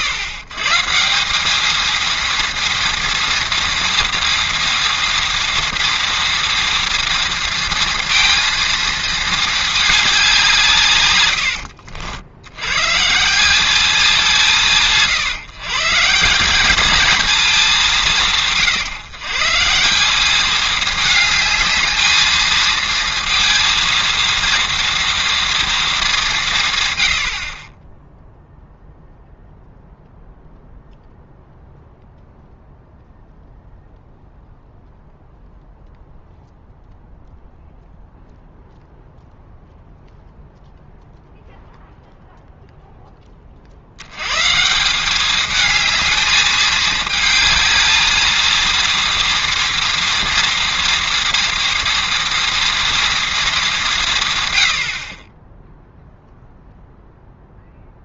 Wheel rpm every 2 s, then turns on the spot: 130, 240, 230, 230, 230, 160, 110, 160, 200, 140, 210, 220, 230, 140, 0, 0, 0, 0, 0, 0, 0, 0, 160, 220, 230, 230, 230, 90, 0.
none